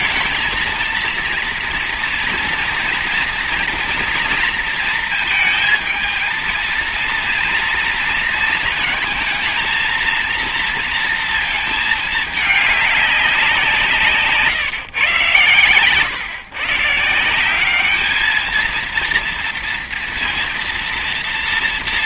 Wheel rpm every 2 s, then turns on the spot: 230, 240, 230, 230, 230, 230, 200, 130, 150, 230, 230.
none